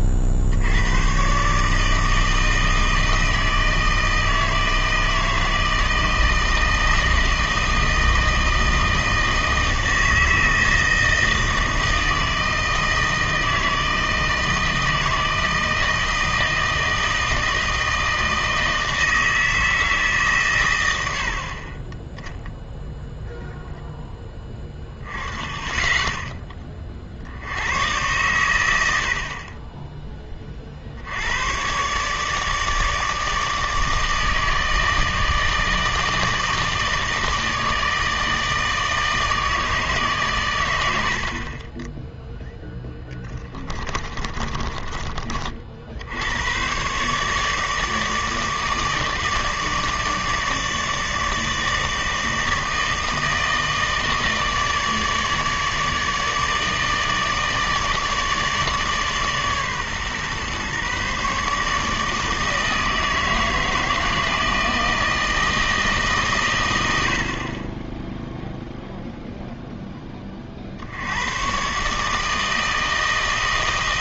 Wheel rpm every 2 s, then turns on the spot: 80, 160, 160, 160, 160, 160, 160, 160, 160, 160, 120, 0, 10, 20, 90, 40, 150, 160, 160, 160, 100, 0, 40, 120, 150, 150, 160, 150, 150, 150, 130, 160, 160, 90, 0, 50, 160.
44-46